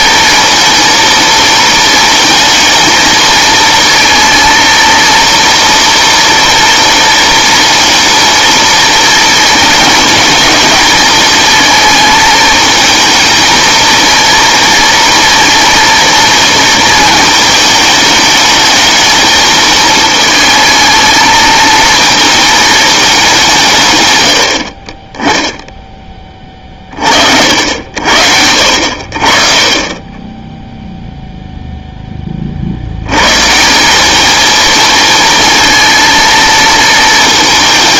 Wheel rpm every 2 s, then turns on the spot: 230, 220, 230, 230, 230, 220, 220, 230, 230, 220, 220, 220, 70, 30, 70, 0, 60, 220, 230.
none